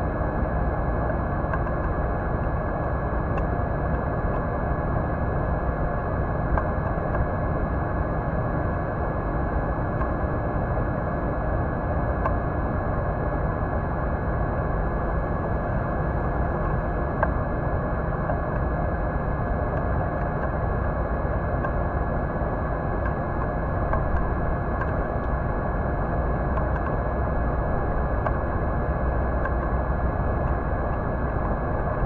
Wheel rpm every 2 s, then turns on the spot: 0, 0, 0, 0, 0, 0, 0, 0, 0, 0, 0, 0, 0, 0, 0, 0.
none